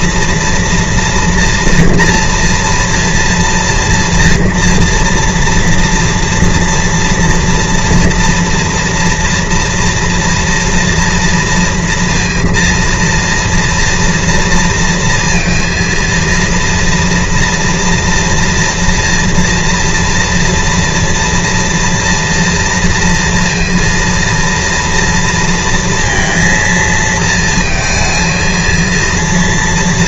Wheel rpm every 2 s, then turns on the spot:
230, 230, 230, 240, 230, 230, 230, 230, 230, 240, 230, 230, 230, 230, 230.
none